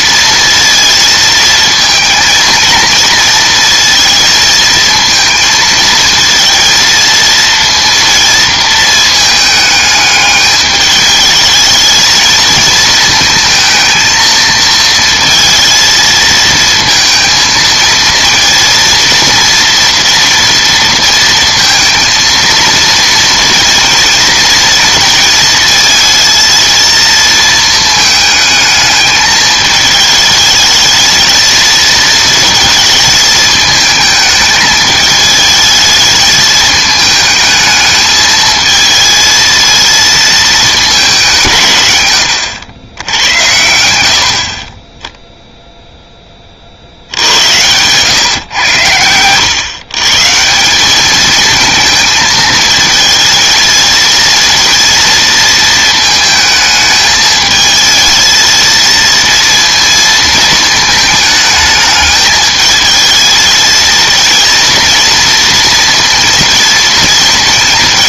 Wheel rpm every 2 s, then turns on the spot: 230, 230, 230, 230, 230, 210, 220, 230, 230, 220, 230, 230, 230, 230, 220, 220, 220, 210, 220, 220, 210, 100, 30, 50, 100, 180, 220, 230, 220, 220, 220, 220, 230, 230.
none